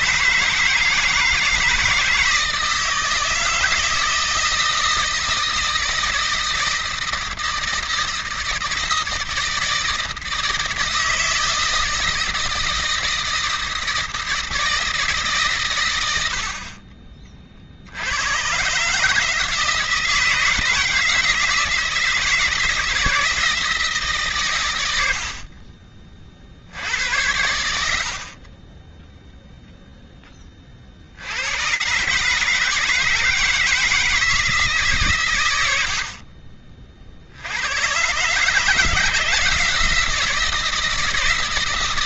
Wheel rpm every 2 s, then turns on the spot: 160, 160, 160, 160, 160, 160, 160, 160, 80, 110, 160, 170, 130, 60, 30, 30, 160, 150, 50, 150, 170.
none